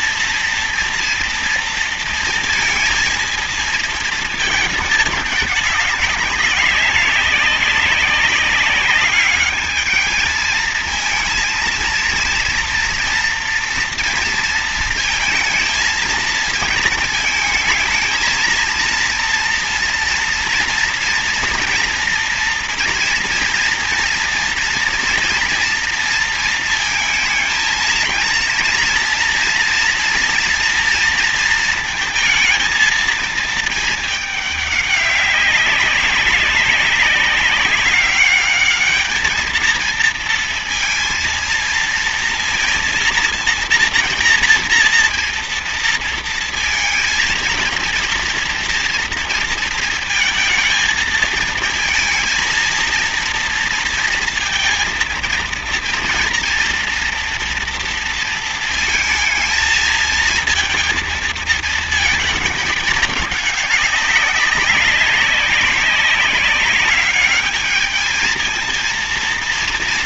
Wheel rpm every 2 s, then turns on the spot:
230, 230, 220, 190, 200, 220, 230, 230, 230, 230, 230, 240, 230, 220, 230, 240, 220, 200, 200, 210, 230, 230, 230, 230, 230, 220, 230, 230, 230, 220, 230, 210, 200, 200, 220.
none